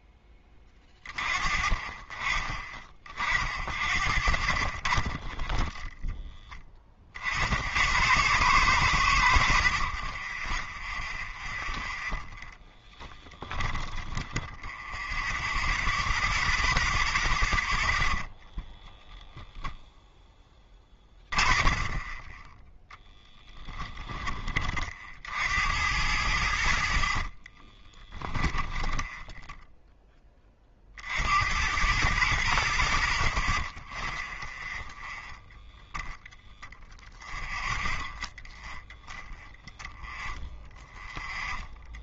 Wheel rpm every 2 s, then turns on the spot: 30, 30, 20, 40, 90, 0, 10, 0, 0, 0, 30, 10, 40, 60, 10, 40, 60, 10, 0, 0, 0.
12-14 20-24 28-30